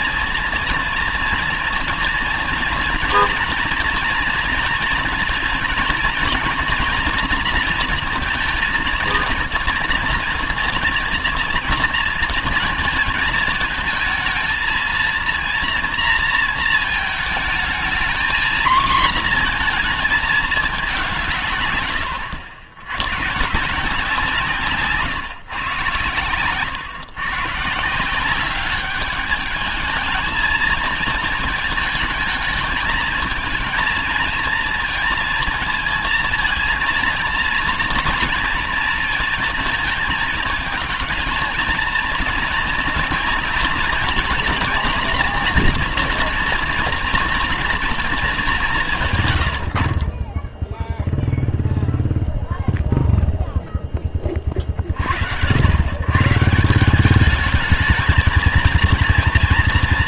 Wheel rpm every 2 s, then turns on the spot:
230, 240, 230, 230, 230, 230, 230, 220, 230, 230, 210, 90, 150, 120, 200, 220, 220, 230, 230, 230, 220, 230, 240, 230, 200, 20, 0, 30, 160, 230.
none